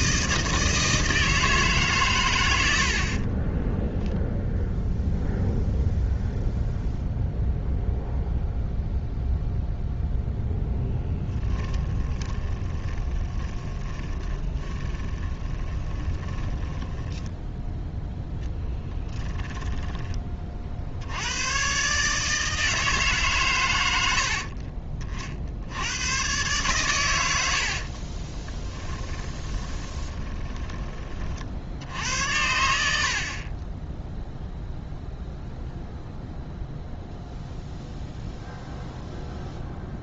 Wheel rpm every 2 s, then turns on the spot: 160, 60, 0, 0, 0, 0, 20, 20, 10, 10, 60, 160, 40, 110, 10, 20, 70, 0, 0, 0.
12-20 28-30